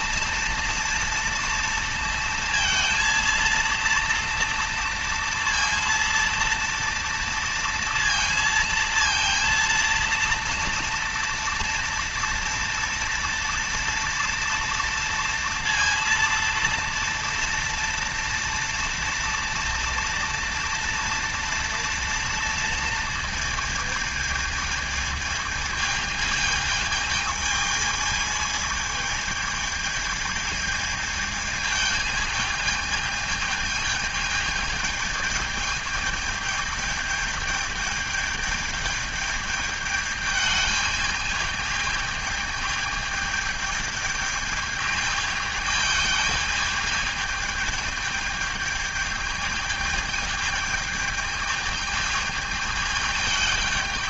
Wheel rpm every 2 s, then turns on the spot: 230, 230, 230, 230, 230, 230, 230, 230, 230, 230, 230, 230, 220, 220, 220, 220, 220, 220, 210, 210, 210, 220, 210, 210, 210, 210, 210.
none